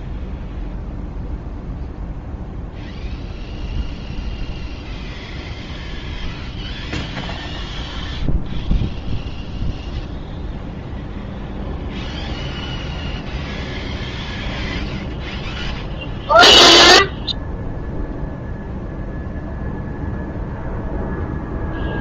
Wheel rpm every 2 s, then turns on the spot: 0, 0, 0, 0, 0, 0, 0, 0, 0, 0, 0.
none